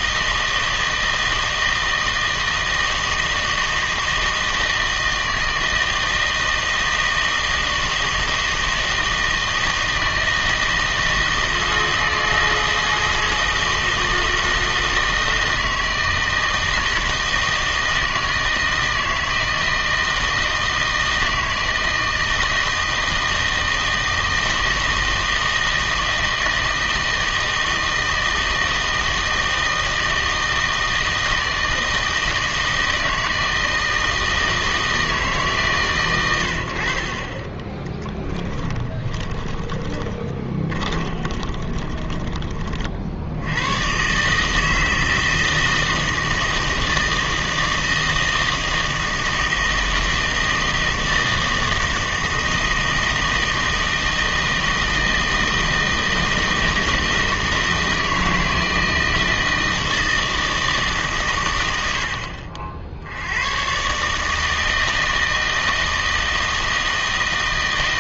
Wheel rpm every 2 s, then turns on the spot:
160, 160, 160, 160, 160, 160, 160, 160, 160, 160, 160, 160, 160, 160, 160, 160, 160, 160, 80, 20, 20, 40, 160, 160, 160, 160, 160, 160, 160, 160, 160, 70, 160, 160.
38-42